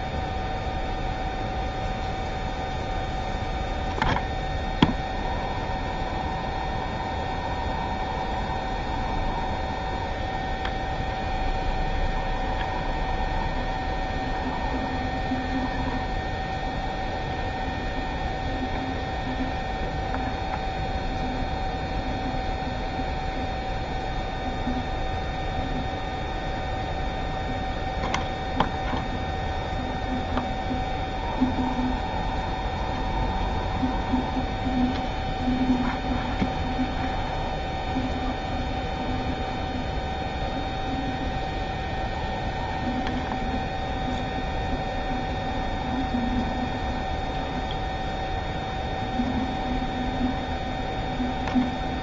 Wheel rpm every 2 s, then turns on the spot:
0, 0, 0, 0, 0, 0, 0, 0, 0, 0, 0, 0, 0, 0, 0, 0, 0, 0, 0, 0, 0, 0, 0, 0, 0, 0.
none